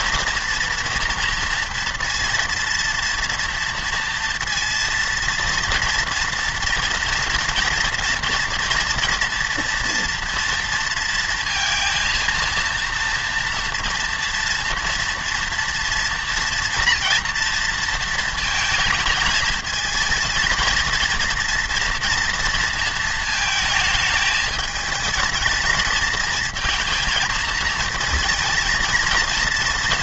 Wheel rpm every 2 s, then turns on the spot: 240, 230, 230, 240, 230, 230, 230, 230, 230, 220, 230, 230, 220, 220, 230.
none